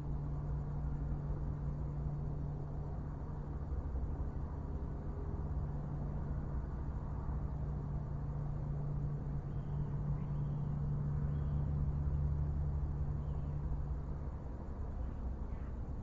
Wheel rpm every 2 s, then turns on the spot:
0, 0, 0, 0, 0, 0, 0, 0.
none